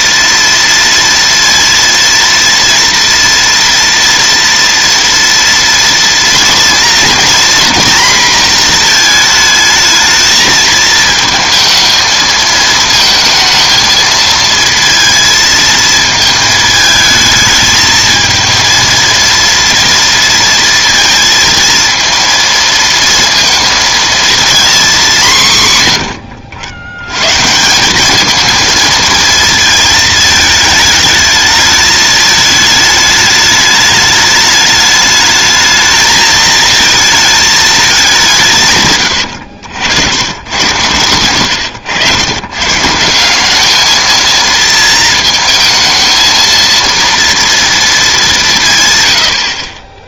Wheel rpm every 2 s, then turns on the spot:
230, 230, 230, 230, 230, 220, 220, 230, 220, 230, 230, 230, 220, 90, 220, 210, 210, 210, 220, 140, 110, 130, 230, 230, 170.
38-40